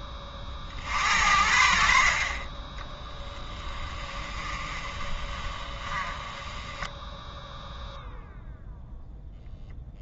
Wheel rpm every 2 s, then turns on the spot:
20, 30, 20, 20, 0.
4-8